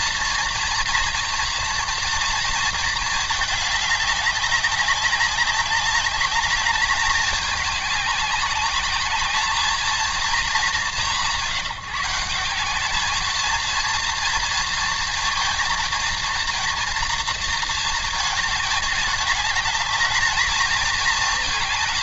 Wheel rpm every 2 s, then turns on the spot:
230, 230, 200, 210, 200, 180, 200, 230, 230, 220, 220.
none